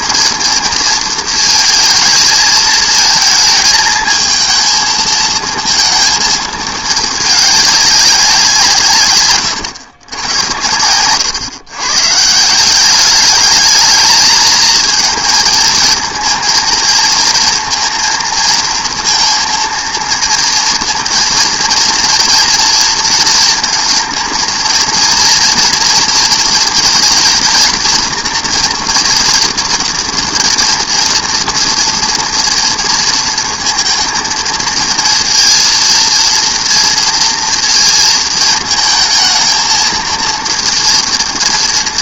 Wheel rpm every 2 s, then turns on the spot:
230, 220, 220, 220, 160, 100, 180, 220, 230, 230, 230, 230, 230, 230, 240, 230, 230, 220, 230, 220, 230.
none